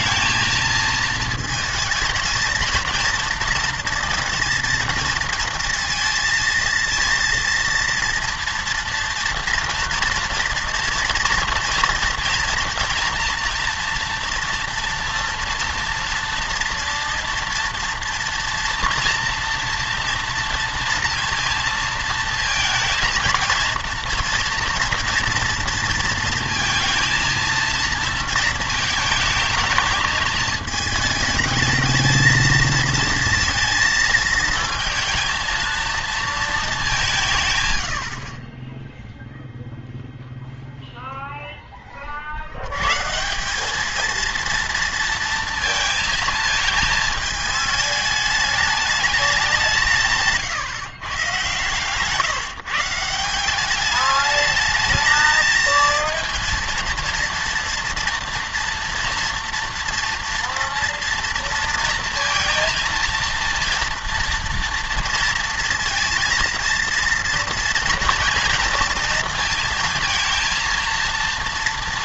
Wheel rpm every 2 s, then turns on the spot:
220, 230, 230, 230, 240, 230, 230, 230, 240, 230, 230, 230, 230, 230, 220, 220, 230, 220, 210, 20, 0, 100, 230, 220, 210, 130, 160, 220, 230, 230, 230, 230, 230, 230, 230, 230.
none